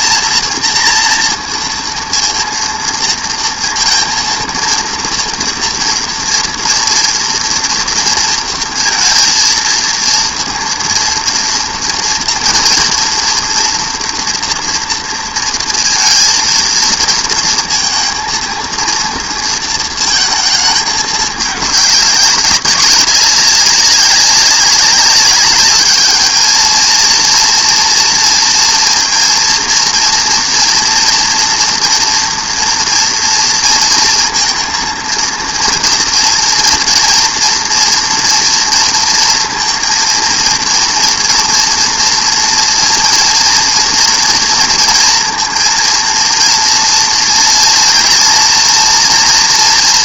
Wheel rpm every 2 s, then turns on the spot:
230, 230, 230, 230, 230, 230, 230, 240, 230, 230, 220, 190, 190, 220, 230, 230, 230, 230, 230, 230, 230, 230, 230, 230, 240.
none